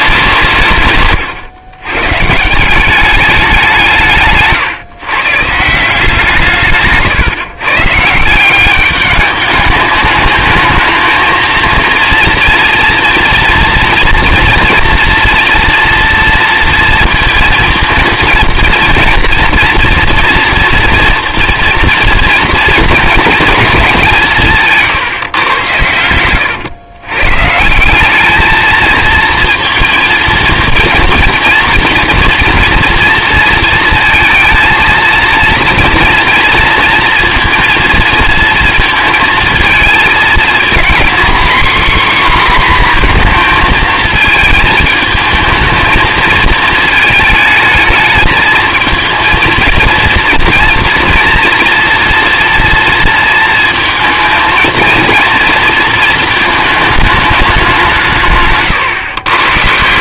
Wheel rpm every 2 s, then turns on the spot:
150, 180, 140, 150, 190, 220, 240, 230, 230, 230, 230, 240, 160, 110, 220, 230, 230, 230, 240, 230, 230, 250, 220, 220, 220, 230, 230, 230, 220, 130.
4-6 58-60